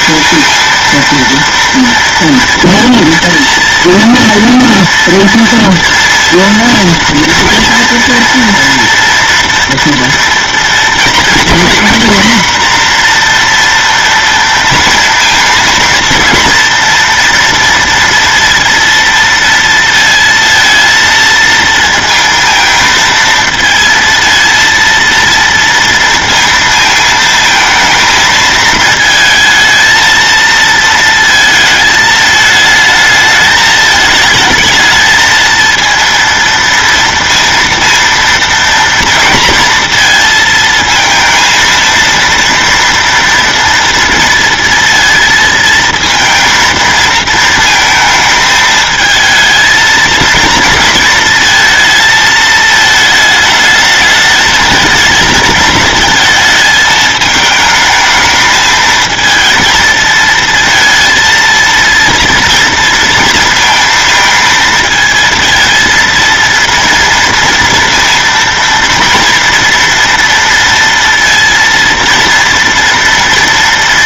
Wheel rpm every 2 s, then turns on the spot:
230, 230, 230, 230, 230, 230, 240, 230, 230, 230, 230, 230, 230, 220, 220, 230, 220, 220, 230, 230, 230, 230, 230, 230, 220, 230, 220, 220, 220, 220, 230, 230, 220, 230, 230, 230, 230.
none